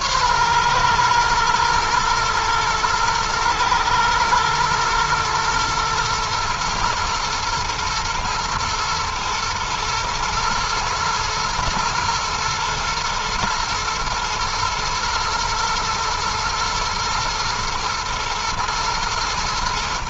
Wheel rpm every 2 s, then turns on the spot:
120, 110, 110, 110, 120, 120, 110, 110, 110, 110.
none